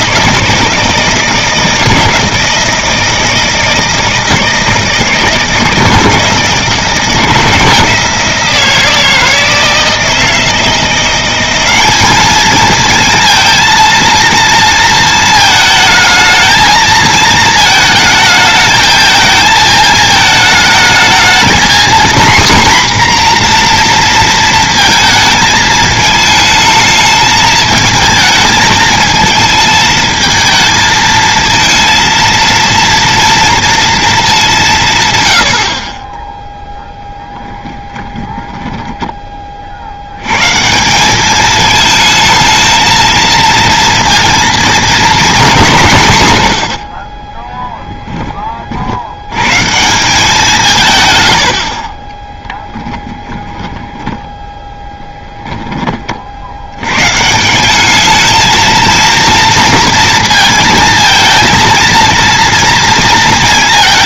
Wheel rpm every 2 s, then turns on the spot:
160, 160, 160, 160, 160, 170, 220, 230, 220, 220, 220, 250, 230, 220, 220, 220, 230, 180, 0, 10, 150, 220, 230, 90, 40, 150, 10, 10, 90, 220, 230, 230.
38-40 52-56